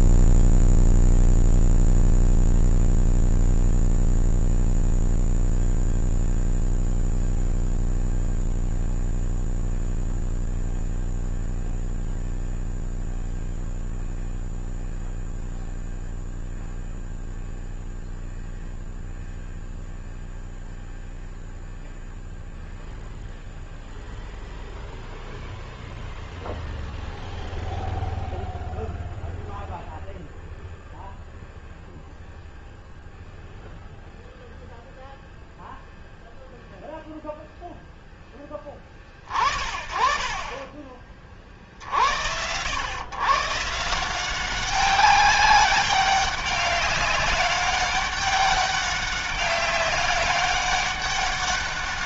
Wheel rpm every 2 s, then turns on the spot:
10, 0, 0, 0, 0, 0, 0, 0, 0, 0, 0, 0, 0, 0, 0, 0, 0, 0, 0, 30, 50, 150, 200, 200, 200, 200.
none